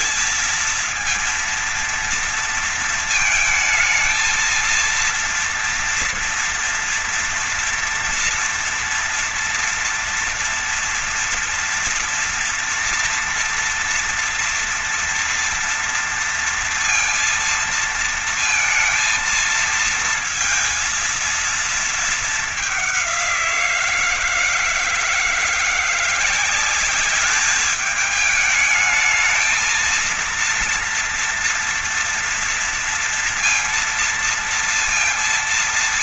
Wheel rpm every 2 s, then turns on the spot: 230, 230, 230, 230, 240, 230, 240, 230, 230, 230, 230, 210, 170, 180, 210, 230, 230, 230.
none